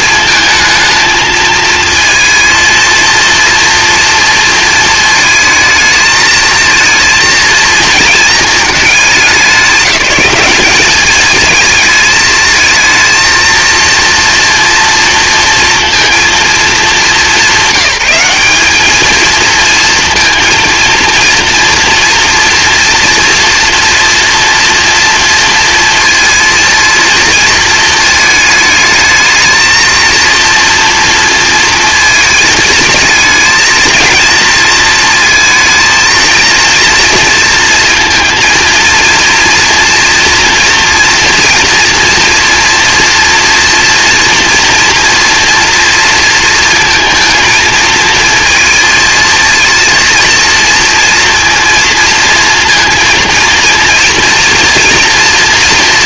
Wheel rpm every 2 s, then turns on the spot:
220, 230, 230, 220, 210, 200, 220, 240, 220, 210, 230, 230, 240, 230, 220, 230, 220, 230, 230, 230, 230, 230, 240, 230, 220, 230, 230, 230.
none